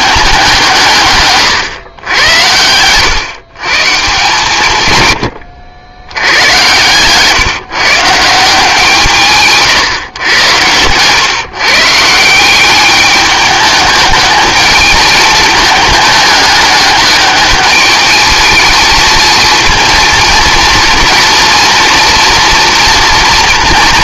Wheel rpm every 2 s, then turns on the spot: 160, 100, 140, 120, 170, 110, 190, 210, 210, 220, 230, 230.
none